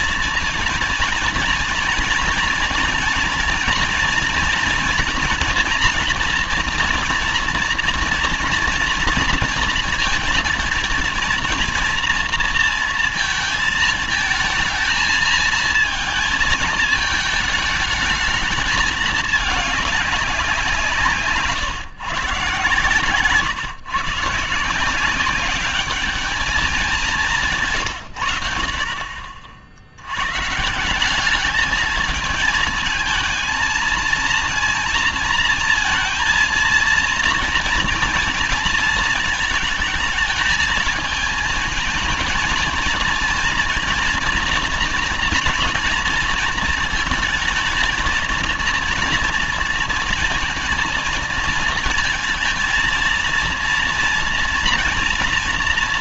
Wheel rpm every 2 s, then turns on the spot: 230, 240, 230, 230, 230, 230, 230, 220, 220, 210, 170, 140, 160, 200, 70, 150, 220, 230, 230, 230, 220, 220, 230, 230, 230, 230, 230, 240.
none